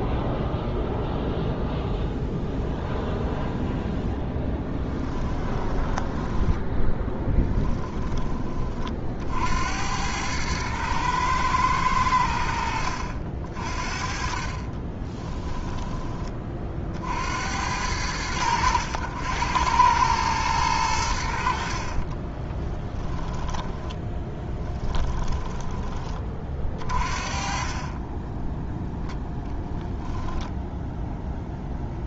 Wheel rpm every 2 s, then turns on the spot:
0, 0, 10, 10, 40, 110, 70, 30, 40, 80, 100, 20, 20, 40, 10, 0.
4-8 14-16 22-26